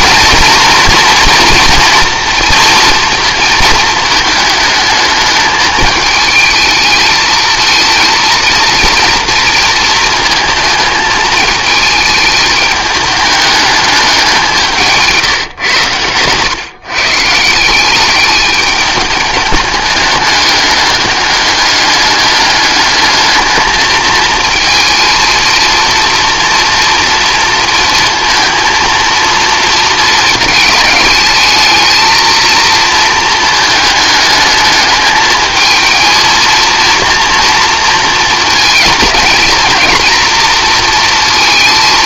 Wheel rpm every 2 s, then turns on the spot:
230, 230, 220, 220, 230, 220, 210, 180, 130, 210, 210, 210, 230, 230, 230, 220, 230, 220, 230, 230, 230.
none